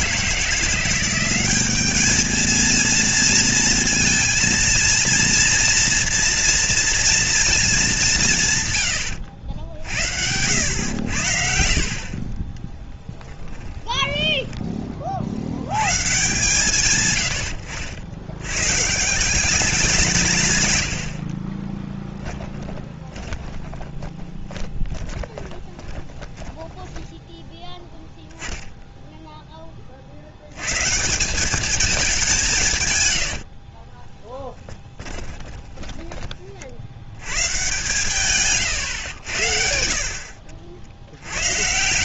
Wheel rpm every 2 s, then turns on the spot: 170, 220, 230, 230, 130, 80, 20, 10, 130, 110, 140, 20, 10, 20, 0, 100, 160, 10, 40, 120, 70.
12-14 22-28 34-36 38-42